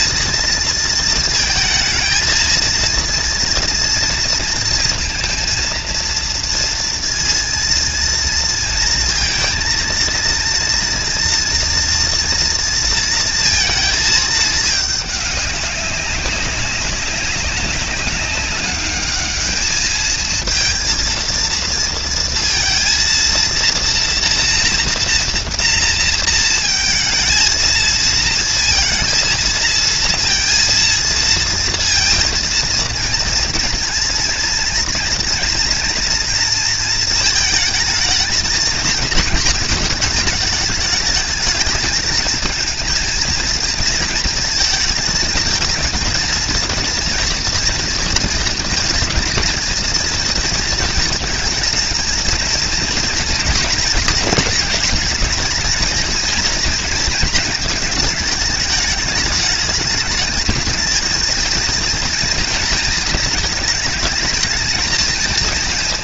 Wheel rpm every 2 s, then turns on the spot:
230, 230, 230, 230, 230, 230, 230, 210, 200, 200, 230, 230, 240, 230, 230, 230, 230, 230, 230, 220, 220, 230, 230, 230, 230, 230, 230, 220, 230, 210, 220, 230, 220.
none